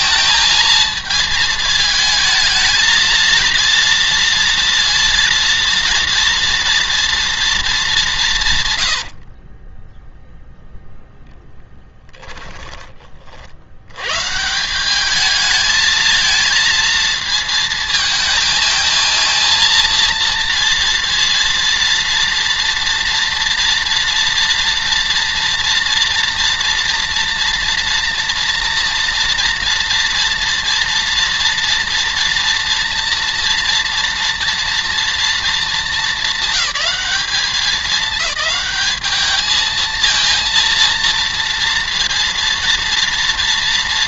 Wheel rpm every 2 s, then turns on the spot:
220, 220, 230, 230, 130, 0, 20, 170, 230, 220, 230, 230, 230, 230, 230, 230, 230, 230, 210, 210, 230, 230.
8-10